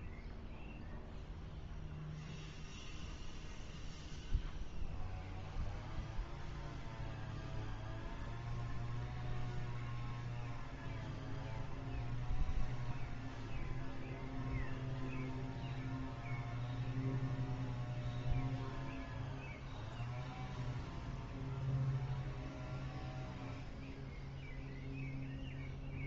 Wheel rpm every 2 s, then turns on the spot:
0, 0, 0, 0, 0, 0, 0, 0, 0, 0, 0, 0, 0.
none